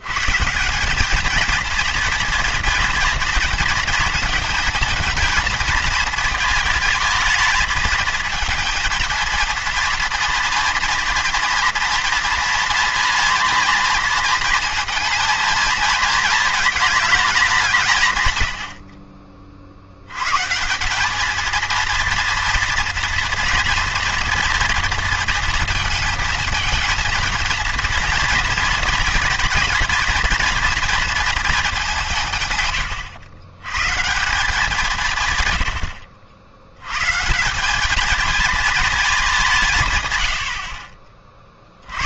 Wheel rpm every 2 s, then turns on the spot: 180, 230, 220, 230, 220, 230, 230, 230, 220, 80, 160, 230, 230, 230, 230, 230, 110, 180, 80, 220, 60.
none